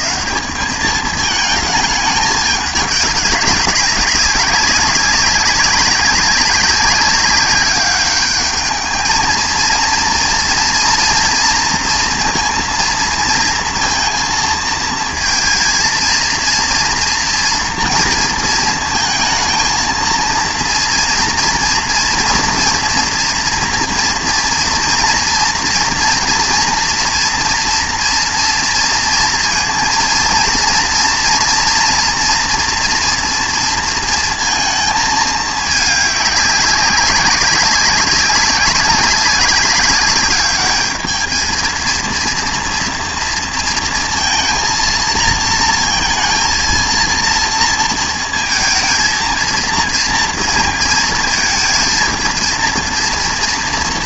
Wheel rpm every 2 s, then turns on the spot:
210, 210, 200, 190, 210, 230, 230, 230, 230, 230, 230, 240, 230, 230, 230, 230, 240, 220, 200, 200, 210, 230, 230, 230, 220, 230, 230.
none